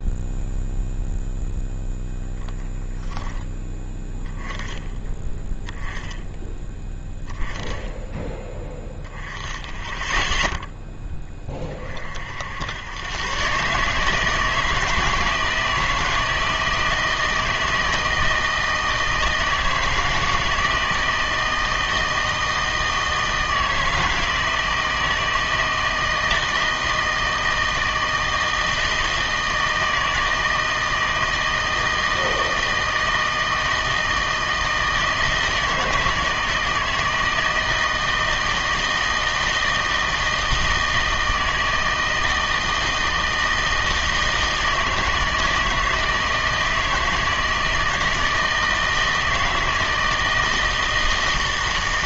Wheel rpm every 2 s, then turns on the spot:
0, 10, 10, 10, 10, 0, 80, 160, 160, 160, 160, 160, 160, 160, 160, 160, 160, 160, 160, 160, 160, 160, 160, 160, 160, 160.
none